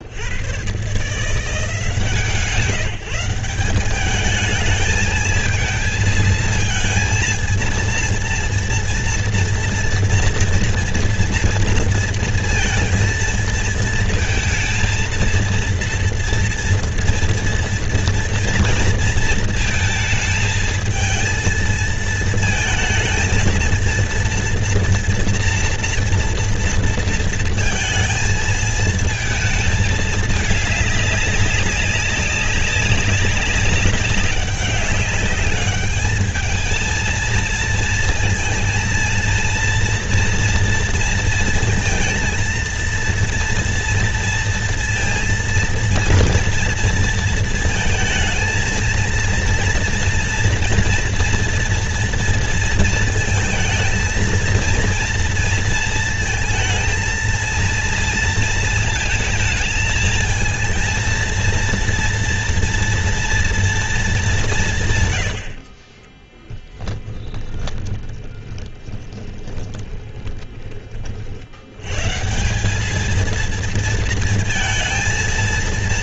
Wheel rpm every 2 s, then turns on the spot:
110, 160, 220, 230, 230, 230, 230, 230, 230, 230, 220, 220, 240, 230, 220, 210, 190, 200, 220, 230, 240, 230, 230, 230, 230, 230, 230, 230, 220, 230, 230, 230, 180, 10, 20, 30, 180, 220.
66-70